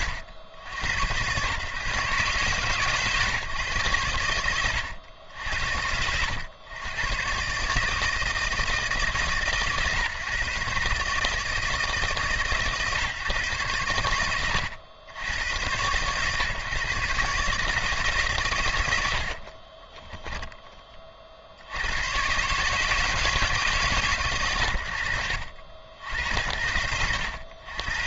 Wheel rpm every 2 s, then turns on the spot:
80, 130, 90, 110, 160, 140, 140, 70, 140, 130, 30, 150, 70, 80.
none